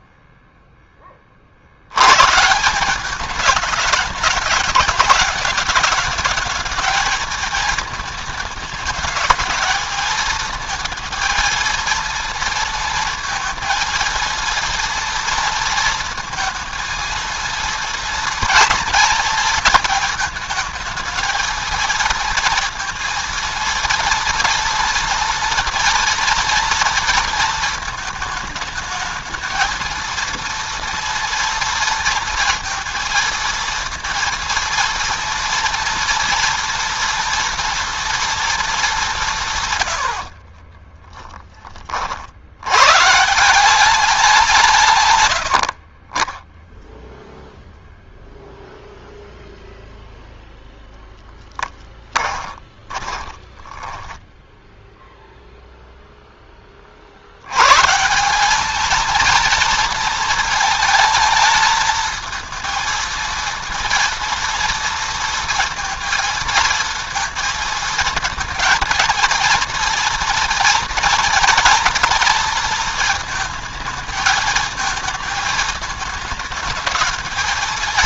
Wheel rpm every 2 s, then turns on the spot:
10, 170, 210, 220, 210, 220, 230, 230, 230, 230, 220, 230, 230, 230, 220, 230, 230, 230, 230, 200, 20, 120, 150, 10, 0, 0, 20, 0, 30, 210, 220, 230, 230, 230, 230, 230, 220, 220, 220.
40-42 52-54